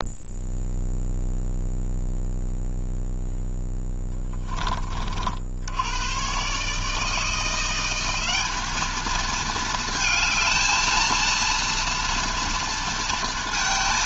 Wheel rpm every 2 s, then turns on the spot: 0, 0, 20, 140, 210, 220, 230.
none